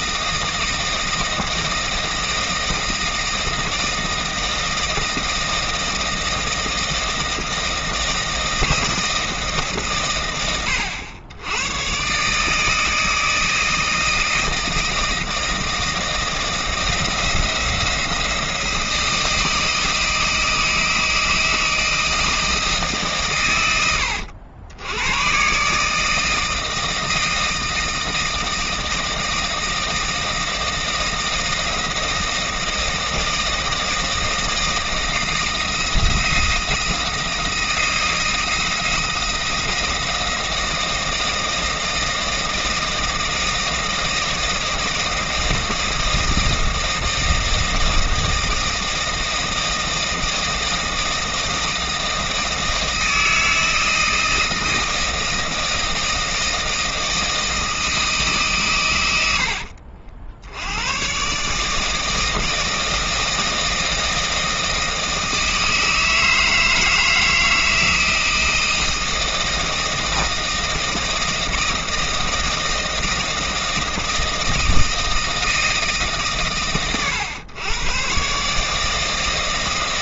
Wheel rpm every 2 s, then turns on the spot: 160, 160, 160, 160, 150, 100, 160, 160, 170, 160, 160, 110, 130, 160, 160, 160, 160, 160, 160, 160, 160, 160, 160, 160, 160, 160, 160, 160, 160, 110, 100, 160, 160, 160, 160, 160, 160, 160, 120, 150.
none